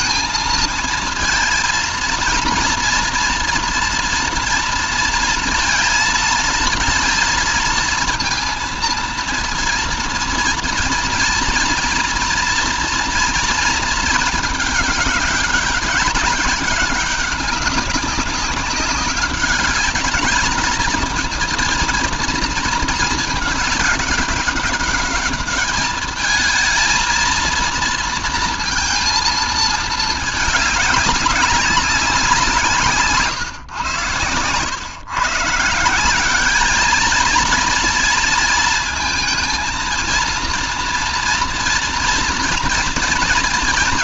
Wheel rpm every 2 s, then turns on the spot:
230, 230, 230, 230, 230, 230, 240, 210, 200, 190, 210, 220, 200, 220, 230, 210, 180, 120, 200, 230, 230, 230.
none